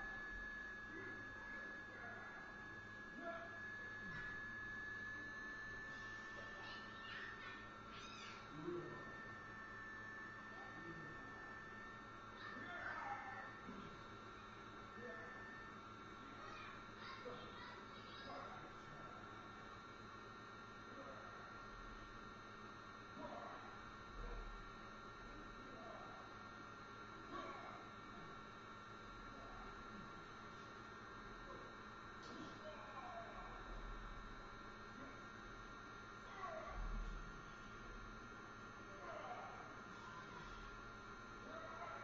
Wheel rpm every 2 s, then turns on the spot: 0, 0, 0, 0, 0, 0, 0, 0, 0, 0, 0, 0, 0, 0, 0, 0, 0, 0, 0, 0, 0.
none